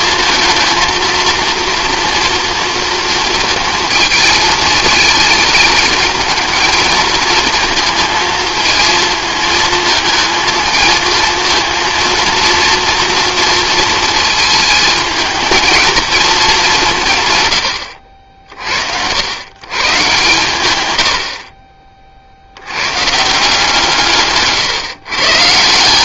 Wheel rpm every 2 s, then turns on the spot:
230, 230, 220, 220, 230, 220, 230, 220, 200, 60, 110, 80, 140.
none